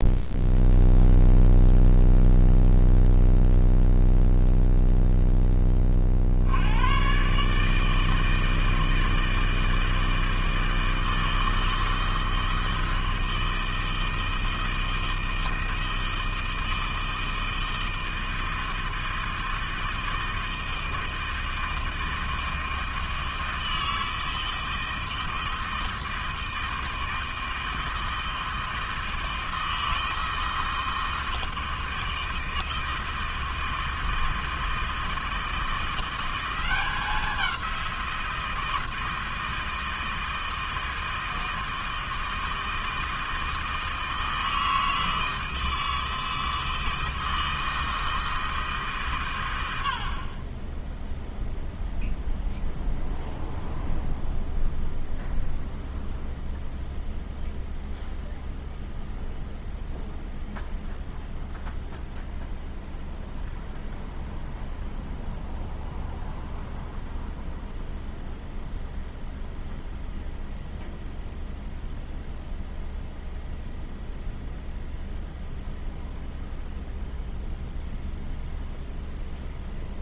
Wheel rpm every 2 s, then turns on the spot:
0, 0, 0, 120, 160, 160, 160, 160, 160, 160, 160, 160, 160, 160, 160, 160, 160, 160, 190, 160, 160, 160, 160, 160, 140, 10, 0, 0, 0, 0, 0, 0, 0, 0, 0, 0, 0, 0, 0, 0.
none